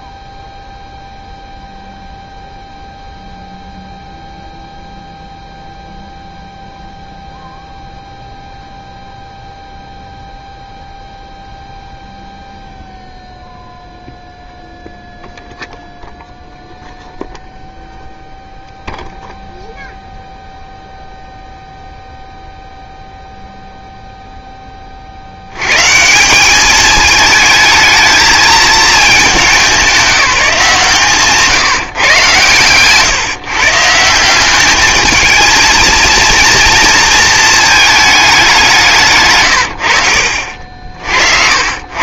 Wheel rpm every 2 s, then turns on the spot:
0, 0, 0, 0, 0, 0, 0, 0, 0, 0, 0, 0, 10, 200, 220, 180, 130, 200, 230, 180, 50.
40-42